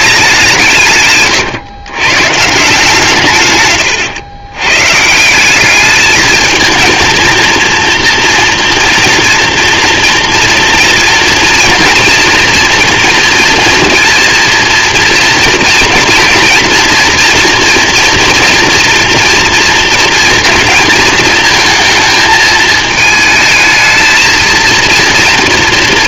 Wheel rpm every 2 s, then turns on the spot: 180, 150, 120, 230, 240, 230, 230, 230, 230, 230, 230, 220, 230.
none